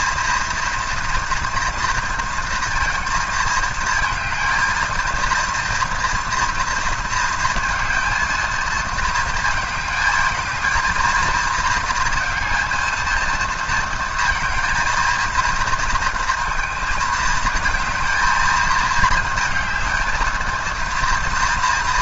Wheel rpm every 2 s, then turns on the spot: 230, 230, 220, 230, 230, 220, 230, 230, 230, 220, 230.
none